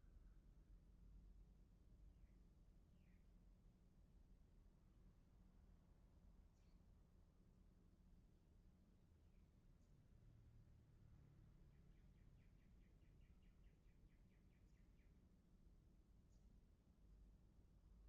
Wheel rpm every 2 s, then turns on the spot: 0, 0, 0, 0, 0, 0, 0, 0, 0.
none